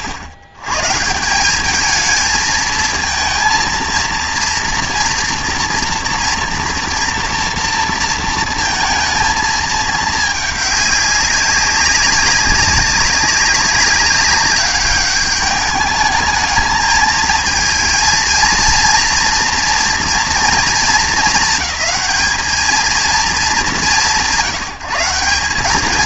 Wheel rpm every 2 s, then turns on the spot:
110, 220, 230, 230, 230, 210, 190, 200, 220, 230, 230, 220, 160.
none